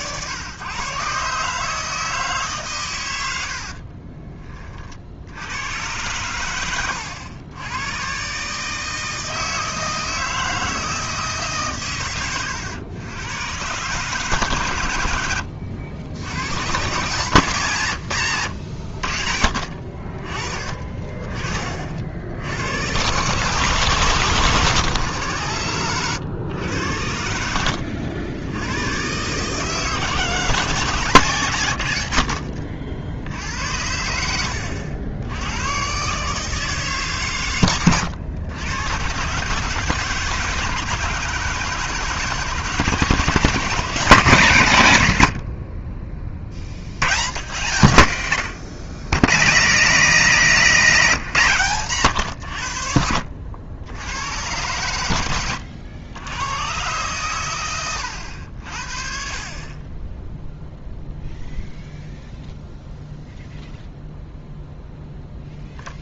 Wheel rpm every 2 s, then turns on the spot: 130, 140, 40, 90, 150, 160, 90, 120, 120, 100, 40, 100, 140, 100, 100, 170, 60, 80, 150, 110, 160, 150, 130, 70, 110, 190, 80, 100, 120, 60, 0, 0, 0.
6-8 34-36 50-52